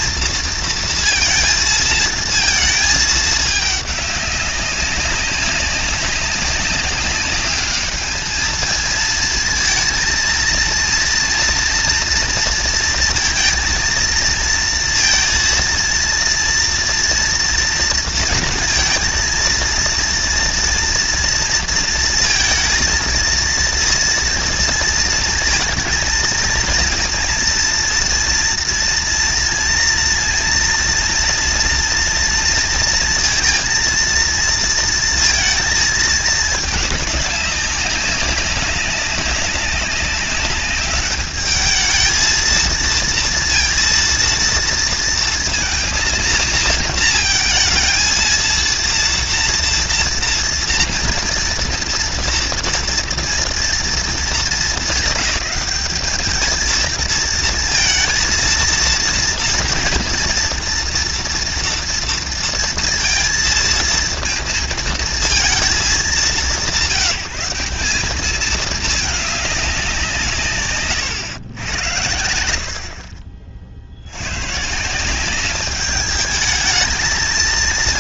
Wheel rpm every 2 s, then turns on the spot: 230, 220, 200, 190, 220, 230, 230, 230, 230, 230, 230, 230, 230, 230, 230, 230, 230, 230, 210, 200, 200, 230, 230, 230, 230, 230, 230, 210, 220, 230, 230, 230, 230, 170, 210, 130, 70, 140, 210.
none